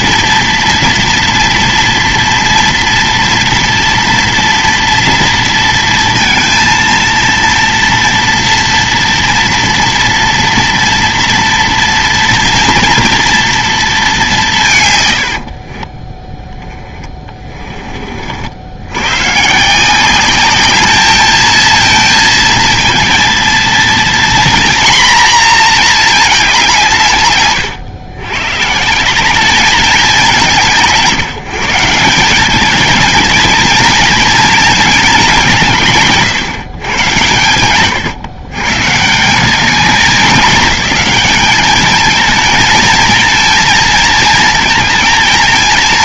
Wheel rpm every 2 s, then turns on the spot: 230, 230, 230, 230, 240, 230, 230, 180, 10, 70, 210, 230, 240, 200, 120, 190, 200, 230, 120, 120, 200, 220, 230.
16-18